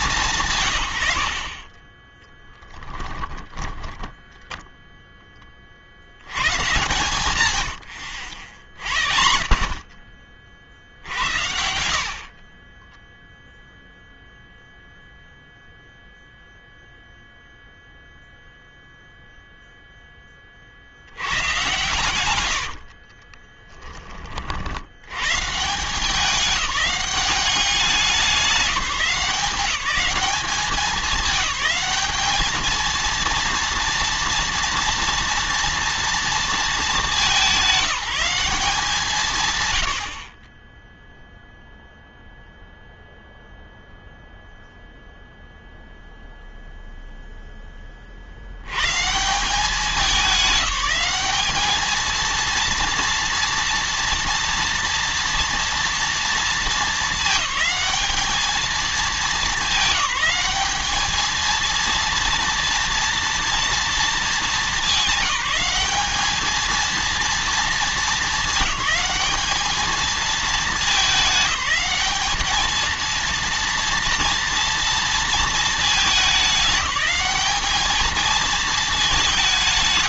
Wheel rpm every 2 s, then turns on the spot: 120, 10, 10, 140, 60, 70, 20, 0, 0, 0, 50, 80, 80, 200, 190, 200, 220, 230, 220, 170, 0, 0, 0, 0, 120, 200, 230, 230, 220, 220, 220, 230, 200, 220, 220, 210, 220, 230, 210, 220.
2-4 22-24